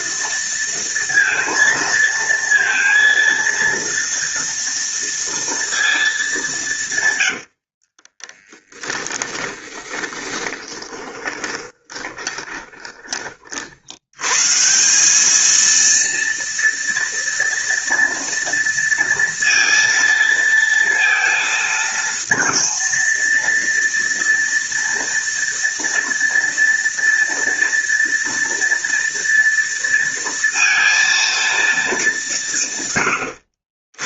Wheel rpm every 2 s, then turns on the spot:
230, 230, 230, 130, 10, 20, 20, 180, 230, 230, 230, 230, 230, 230, 230, 230, 140.
8-12